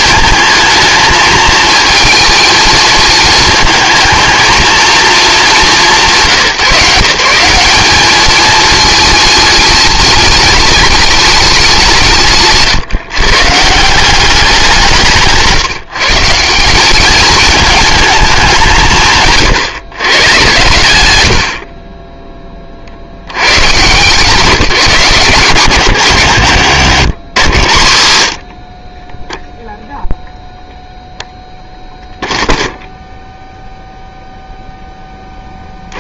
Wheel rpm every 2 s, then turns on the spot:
220, 220, 230, 160, 220, 210, 140, 180, 190, 180, 110, 20, 170, 100, 40, 0, 0, 10.
26-28